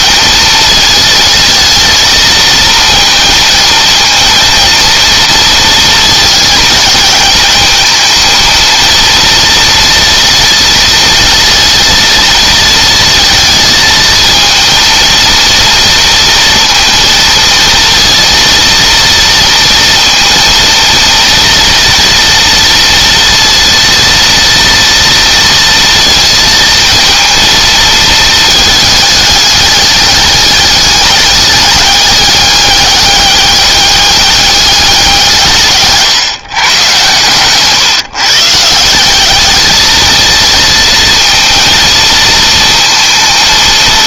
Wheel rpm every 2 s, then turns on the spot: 220, 230, 230, 220, 230, 230, 230, 220, 230, 230, 230, 230, 230, 230, 220, 200, 200, 200, 130, 170, 230, 230.
none